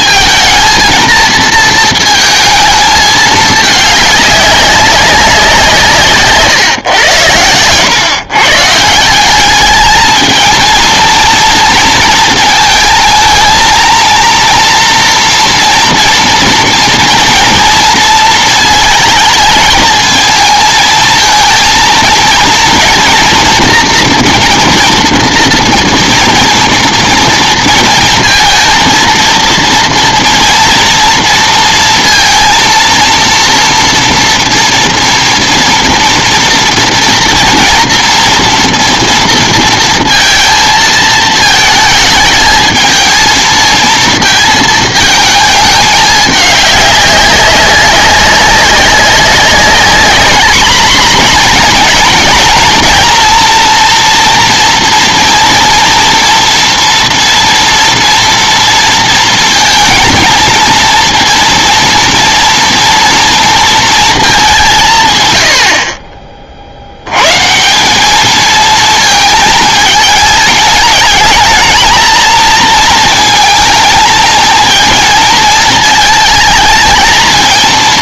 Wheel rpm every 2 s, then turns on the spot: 230, 230, 200, 140, 140, 220, 220, 230, 230, 230, 220, 230, 230, 230, 230, 240, 230, 230, 230, 230, 220, 220, 220, 200, 200, 230, 230, 230, 230, 230, 230, 230, 190, 50, 220, 220, 230, 220, 220.
none